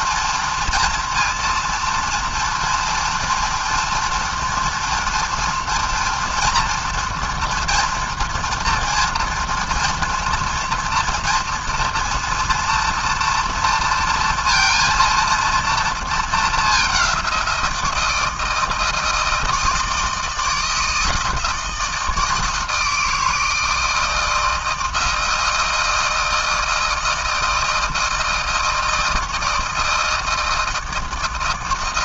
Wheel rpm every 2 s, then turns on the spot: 230, 230, 240, 230, 230, 230, 230, 230, 200, 160, 160, 160, 160, 160, 160, 160.
none